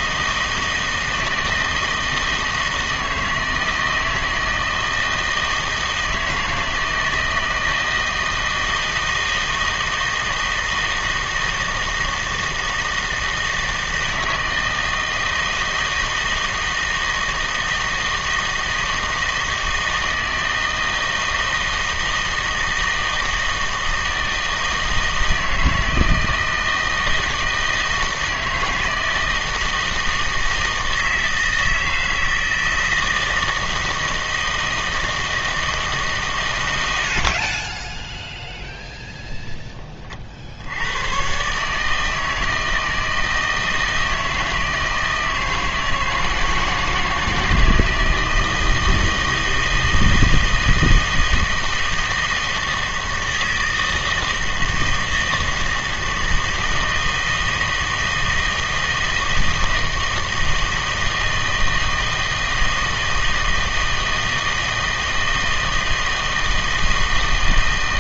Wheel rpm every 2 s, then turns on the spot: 160, 160, 160, 160, 160, 160, 160, 160, 160, 160, 160, 160, 160, 160, 160, 160, 160, 160, 110, 0, 80, 160, 160, 160, 160, 160, 160, 160, 160, 160, 160, 160, 160, 160.
none